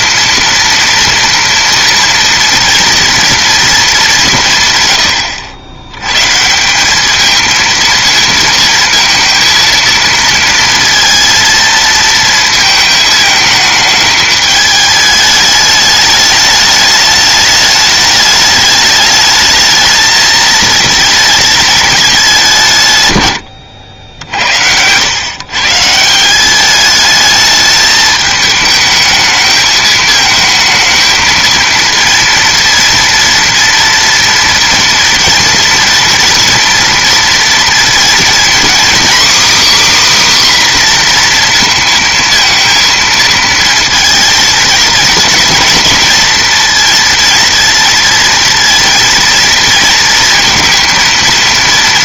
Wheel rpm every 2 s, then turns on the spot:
230, 230, 130, 180, 230, 230, 220, 210, 210, 210, 220, 160, 80, 200, 220, 220, 230, 230, 230, 250, 270, 230, 230, 230, 230, 230.
none